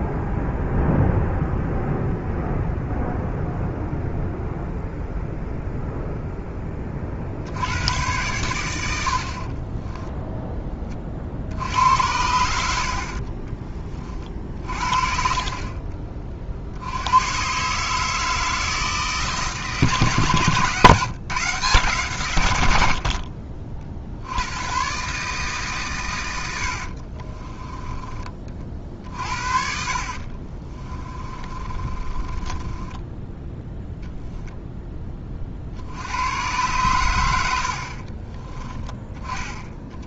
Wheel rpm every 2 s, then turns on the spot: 0, 0, 0, 20, 100, 20, 70, 40, 60, 160, 140, 90, 110, 80, 40, 30, 20, 10, 100, 20.
12-16 26-34 38-40